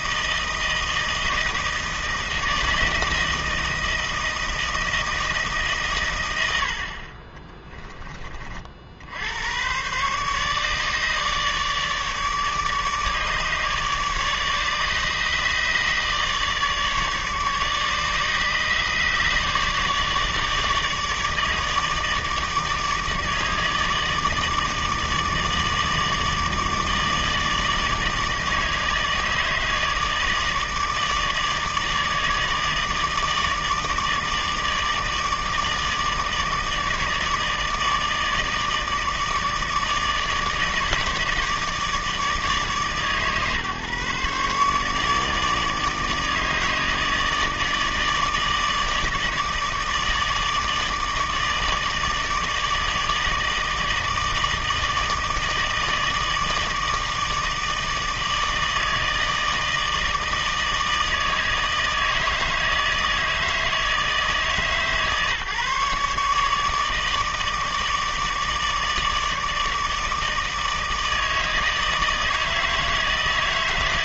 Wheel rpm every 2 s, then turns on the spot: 160, 160, 160, 70, 60, 150, 150, 150, 150, 150, 150, 160, 160, 150, 150, 160, 150, 160, 150, 160, 160, 150, 150, 150, 150, 160, 150, 160, 160, 160, 160, 160, 150, 150, 150, 160, 160.
none